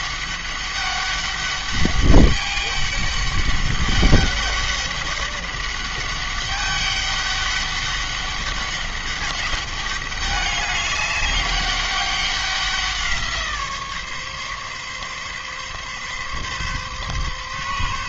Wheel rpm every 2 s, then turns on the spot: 200, 200, 200, 200, 200, 200, 180, 140, 140.
none